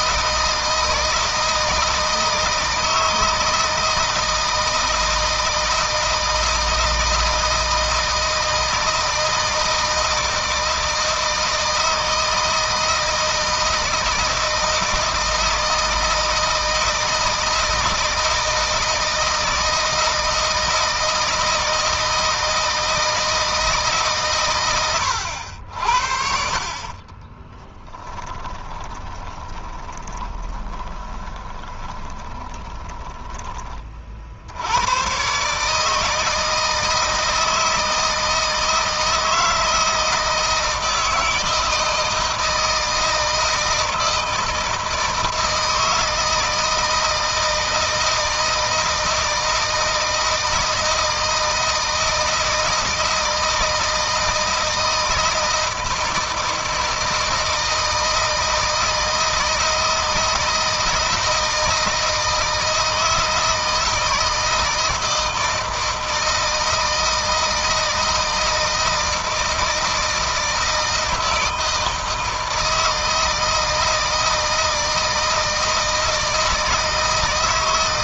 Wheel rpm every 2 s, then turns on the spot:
160, 160, 160, 160, 160, 160, 160, 160, 160, 160, 160, 160, 110, 30, 10, 20, 20, 100, 160, 160, 160, 160, 160, 160, 160, 160, 160, 160, 160, 160, 170, 160, 160, 170, 160, 160, 160, 160, 160.
26-34